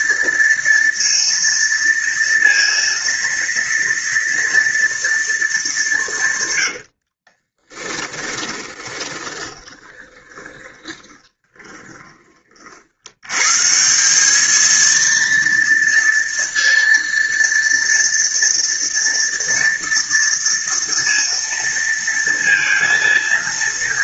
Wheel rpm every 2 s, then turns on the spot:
230, 230, 230, 90, 20, 20, 60, 220, 230, 230, 230, 230.
6-12